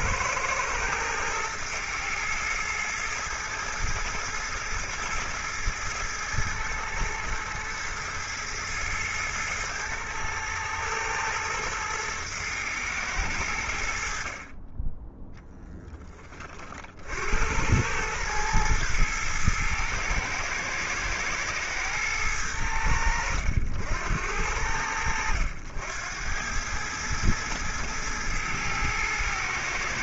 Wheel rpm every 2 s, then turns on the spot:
110, 110, 110, 110, 110, 110, 110, 20, 50, 110, 110, 70, 80, 110, 110.
none